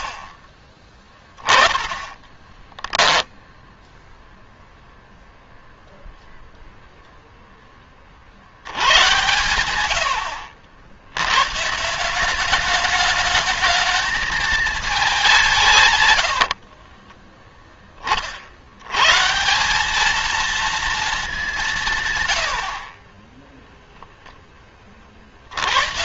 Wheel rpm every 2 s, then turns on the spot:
40, 10, 0, 0, 100, 80, 200, 220, 60, 80, 230, 60, 30.
2-4 16-18